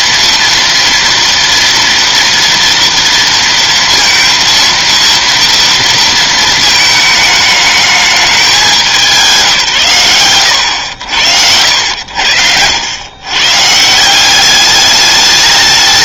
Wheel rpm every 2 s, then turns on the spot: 230, 230, 230, 220, 200, 80, 90, 200.
none